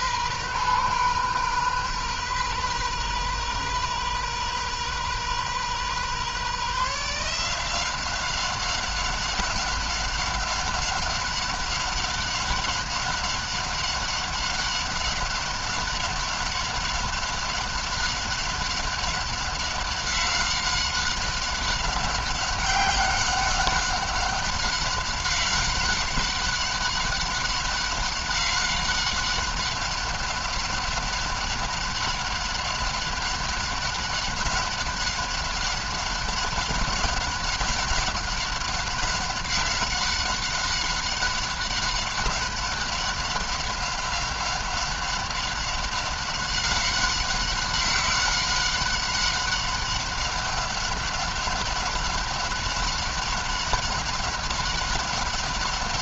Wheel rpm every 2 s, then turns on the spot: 130, 130, 130, 140, 190, 190, 190, 190, 190, 190, 190, 190, 190, 190, 190, 190, 190, 190, 190, 190, 190, 190, 190, 190, 190, 190, 200, 190.
none